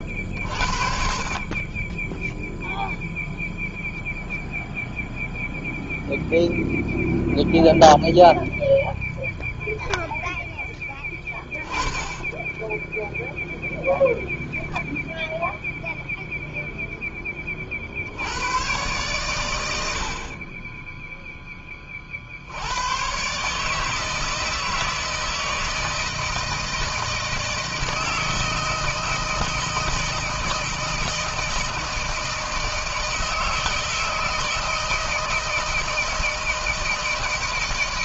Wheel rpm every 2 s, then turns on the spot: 50, 0, 0, 0, 0, 10, 10, 0, 10, 110, 10, 110, 160, 160, 160, 160, 160, 160, 160.
none